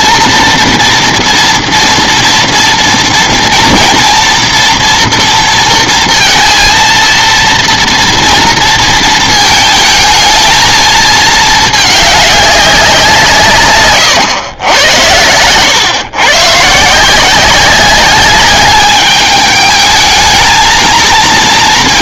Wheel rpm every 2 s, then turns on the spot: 230, 230, 240, 230, 230, 220, 200, 110, 140, 200, 230.
none